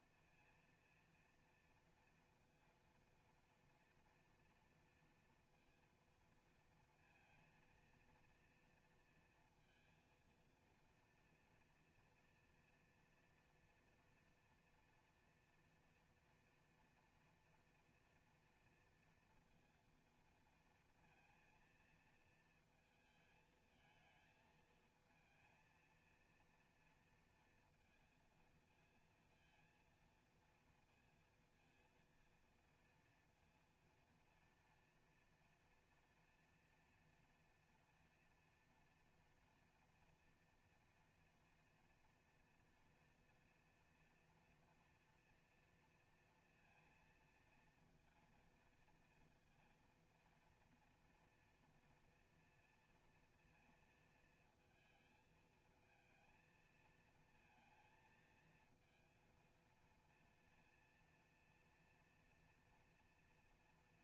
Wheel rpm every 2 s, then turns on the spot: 230, 230, 230, 230, 230, 230, 230, 230, 230, 230, 230, 230, 220, 230, 230, 230, 230, 230, 230, 230, 230, 230, 230, 230, 230, 230, 240, 230, 220, 230, 230, 230.
none